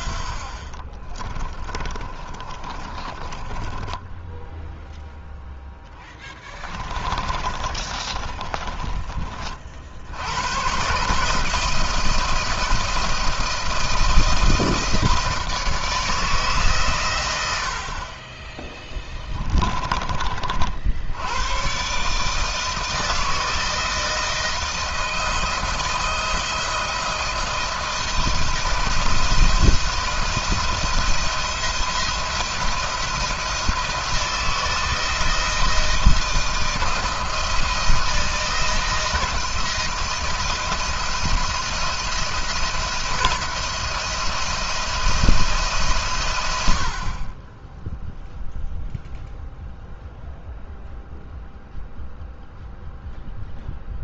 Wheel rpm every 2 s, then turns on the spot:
30, 20, 0, 20, 40, 140, 160, 160, 130, 20, 70, 160, 170, 160, 170, 170, 170, 160, 160, 170, 170, 170, 170, 70, 0, 0, 0.
0-4 6-10 18-20